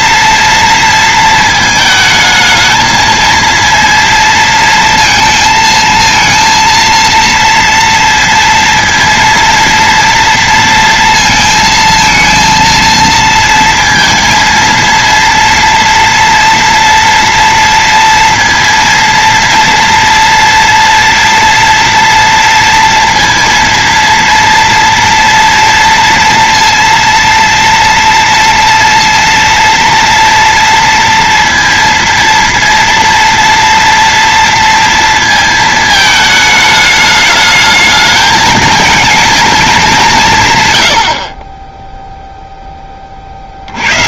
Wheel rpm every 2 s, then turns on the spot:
230, 220, 230, 230, 230, 230, 230, 230, 230, 230, 230, 230, 230, 230, 230, 230, 230, 230, 210, 230, 110, 20.
none